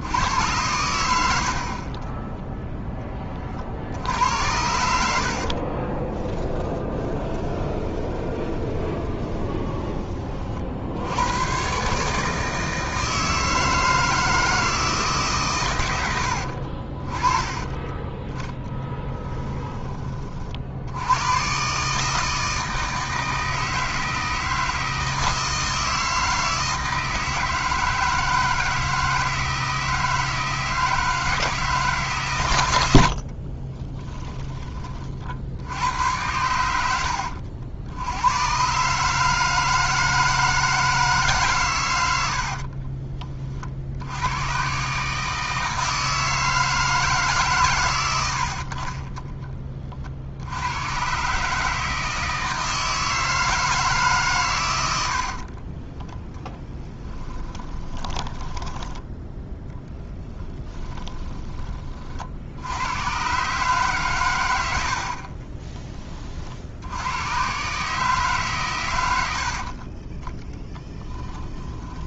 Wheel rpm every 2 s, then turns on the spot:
80, 10, 80, 20, 20, 70, 160, 160, 40, 10, 70, 160, 160, 160, 160, 160, 90, 40, 80, 140, 160, 40, 140, 160, 50, 110, 160, 90, 10, 10, 10, 100, 70, 90, 100, 10.
4-10 18-20 42-44 48-50 56-62 70-72